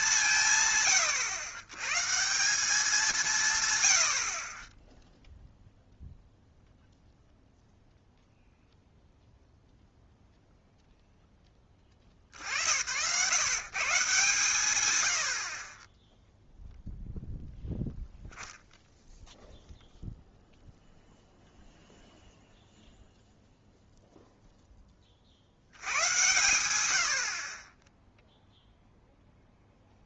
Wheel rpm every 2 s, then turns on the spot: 130, 190, 20, 0, 0, 0, 70, 120, 0, 0, 0, 0, 10, 100, 0.
none